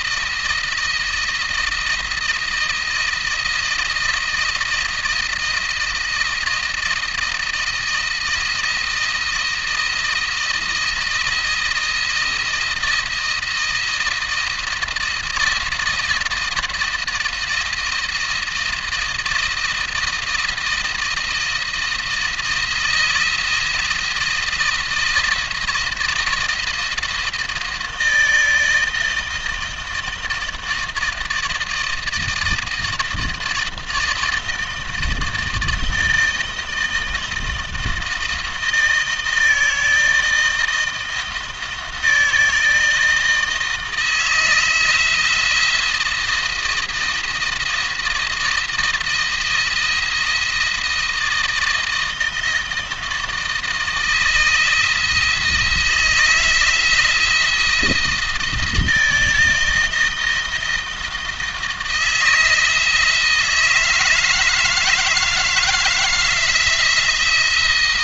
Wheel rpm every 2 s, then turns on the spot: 160, 160, 160, 160, 170, 160, 170, 160, 170, 170, 160, 170, 160, 170, 160, 160, 160, 160, 160, 160, 160, 160, 160, 170, 170, 170, 160, 160, 170, 160, 160, 160, 160, 160.
none